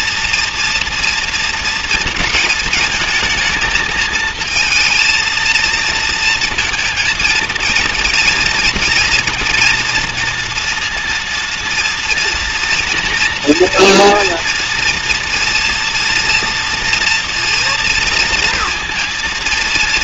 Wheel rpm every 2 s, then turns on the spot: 230, 220, 220, 230, 230, 230, 230, 230, 230, 230.
none